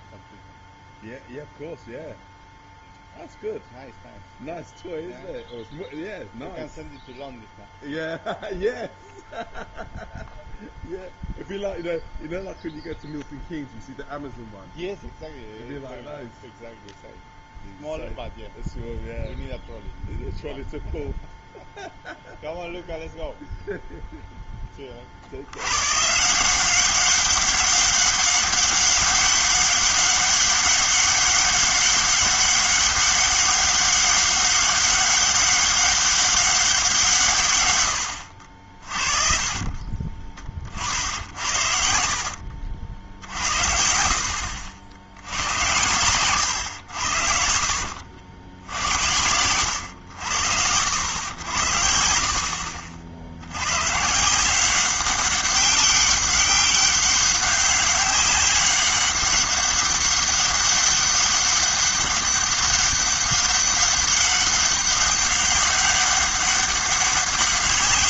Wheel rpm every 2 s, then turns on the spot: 0, 0, 0, 0, 0, 0, 0, 0, 0, 0, 0, 0, 10, 180, 200, 200, 200, 200, 190, 60, 40, 60, 70, 110, 70, 70, 60, 180, 200, 200, 200, 200, 200, 200.
46-48 52-54